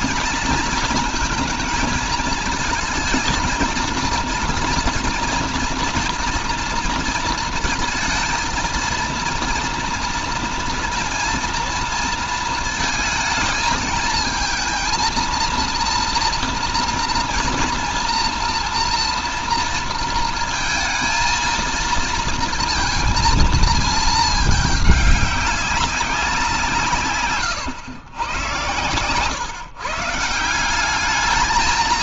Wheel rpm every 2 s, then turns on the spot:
230, 220, 230, 230, 230, 230, 220, 220, 230, 230, 230, 230, 210, 170, 120, 180.
none